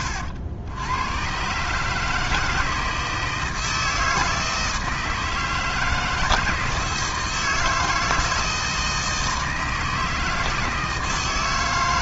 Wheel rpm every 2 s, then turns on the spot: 100, 160, 160, 160, 160, 160.
none